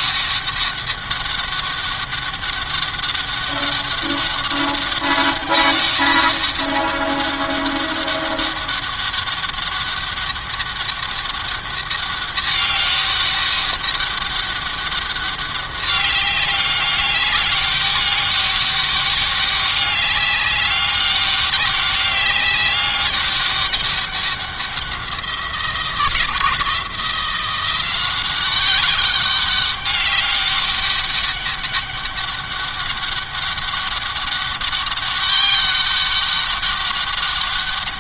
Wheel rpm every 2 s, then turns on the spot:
200, 200, 200, 200, 200, 200, 200, 200, 200, 200, 200, 200, 180, 170, 200, 200, 200, 200, 200.
none